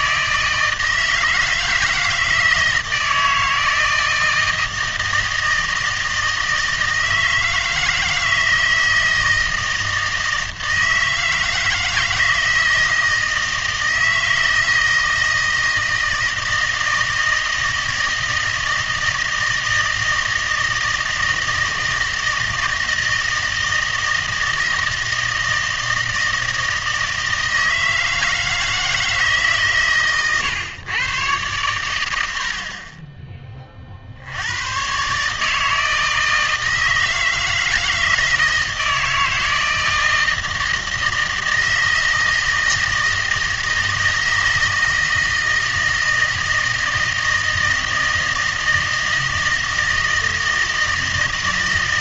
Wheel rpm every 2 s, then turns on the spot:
160, 160, 160, 160, 160, 160, 160, 160, 160, 160, 160, 160, 160, 160, 160, 120, 50, 110, 160, 160, 160, 160, 160, 160, 160, 160.
none